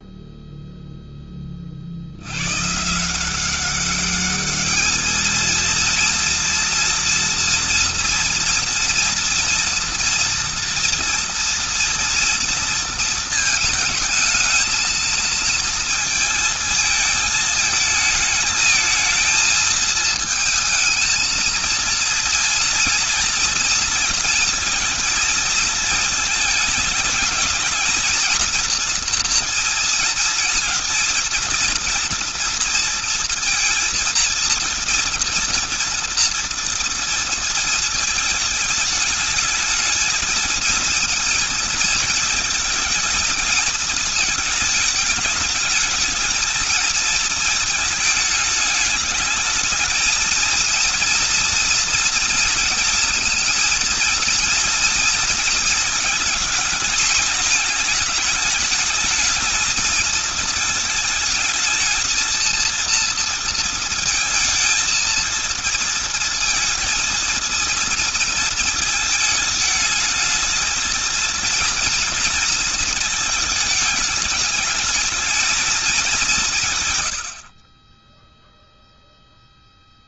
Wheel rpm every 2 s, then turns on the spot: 10, 100, 210, 230, 230, 230, 230, 220, 220, 220, 220, 230, 220, 220, 230, 230, 230, 230, 230, 220, 220, 220, 220, 220, 210, 220, 230, 230, 220, 220, 220, 230, 230, 230, 230, 220, 230, 210, 180, 0.
none